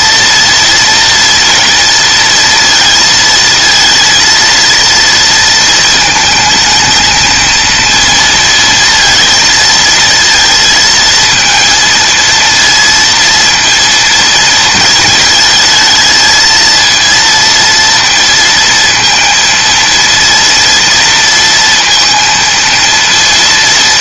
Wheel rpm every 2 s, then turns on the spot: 230, 230, 230, 220, 230, 230, 230, 230, 230, 230, 230, 230.
none